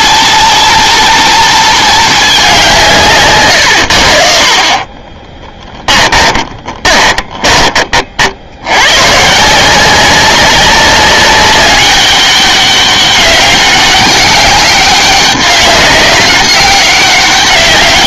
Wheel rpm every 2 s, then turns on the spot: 230, 170, 40, 30, 110, 190, 200, 200, 200.
4-8